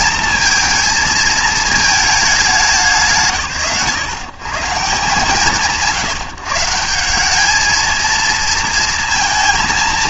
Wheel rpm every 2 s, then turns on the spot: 230, 170, 130, 170, 220.
none